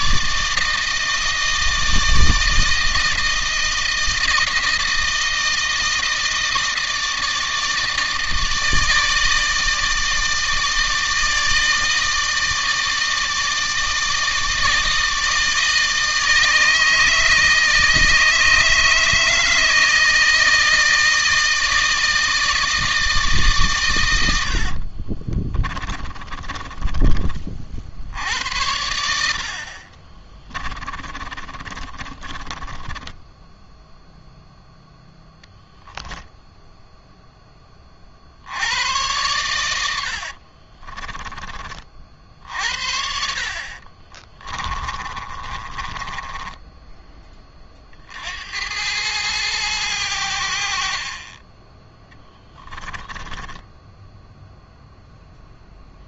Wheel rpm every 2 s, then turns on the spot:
150, 160, 160, 160, 160, 160, 160, 160, 160, 150, 160, 160, 80, 30, 80, 20, 20, 0, 0, 60, 40, 60, 30, 10, 80, 60, 10, 0.
24-28 30-34 40-48 52-54